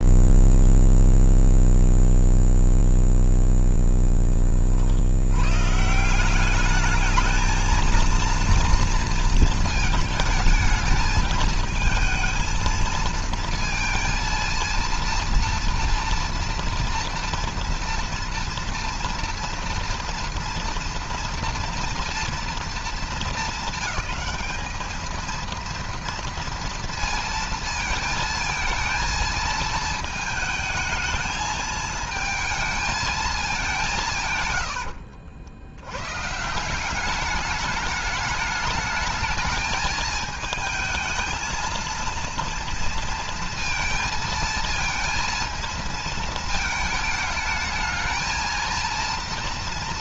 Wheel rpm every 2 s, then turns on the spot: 0, 0, 20, 190, 230, 220, 230, 230, 240, 230, 230, 220, 200, 230, 230, 220, 220, 120, 160, 210, 220, 230, 230, 220, 230.
none